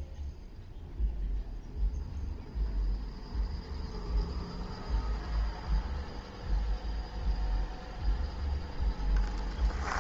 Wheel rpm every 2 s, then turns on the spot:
0, 0, 0, 0, 0.
none